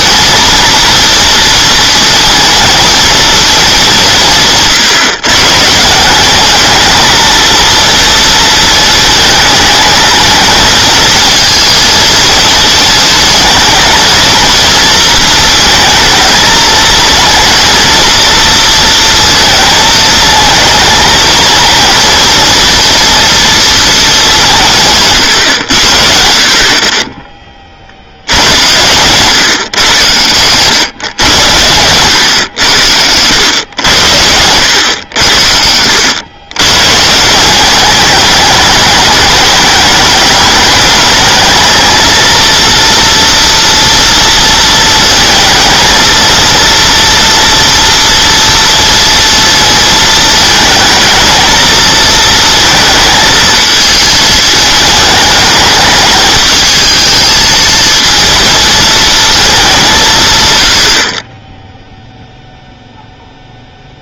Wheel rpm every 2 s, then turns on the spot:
220, 230, 160, 190, 230, 220, 230, 230, 220, 230, 220, 230, 210, 50, 90, 120, 100, 90, 110, 210, 210, 230, 230, 230, 230, 220, 230, 220, 220, 230, 120, 0.
none